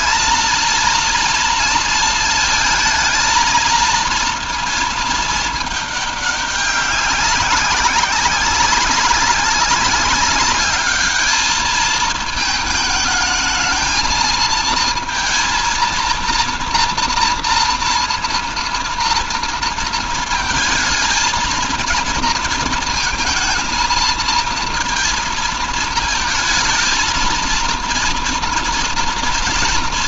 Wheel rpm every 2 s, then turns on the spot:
230, 220, 220, 190, 200, 210, 220, 230, 240, 230, 220, 230, 230, 230, 230.
none